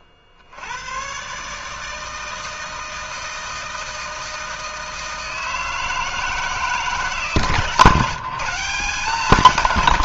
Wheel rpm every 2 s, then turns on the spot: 70, 160, 160, 160, 170.
none